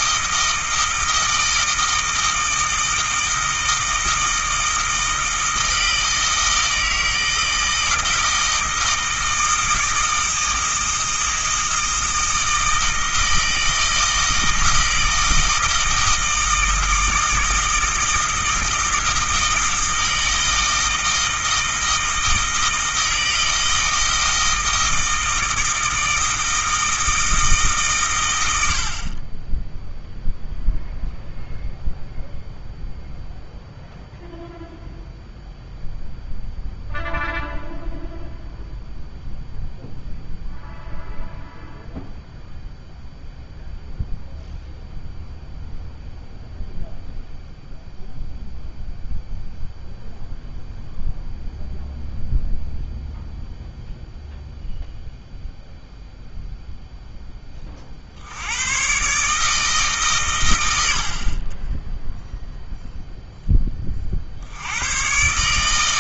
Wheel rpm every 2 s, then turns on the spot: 160, 160, 160, 160, 160, 160, 160, 160, 160, 160, 160, 160, 160, 160, 60, 0, 0, 0, 0, 0, 0, 0, 0, 0, 0, 0, 0, 0, 0, 120, 70, 0, 110.
none